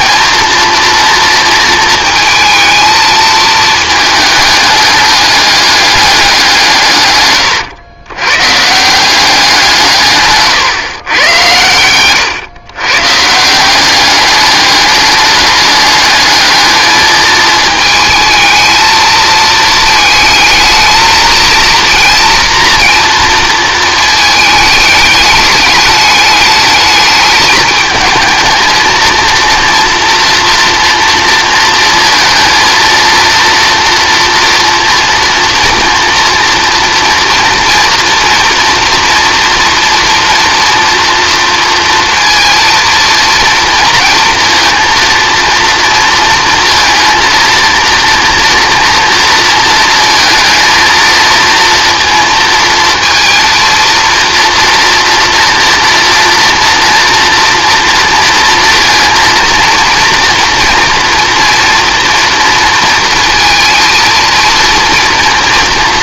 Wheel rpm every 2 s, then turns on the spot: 230, 220, 210, 160, 150, 140, 120, 200, 220, 220, 220, 240, 210, 210, 220, 230, 220, 230, 230, 230, 230, 230, 230, 230, 230, 230, 230, 230, 240, 240, 230, 230, 230.
none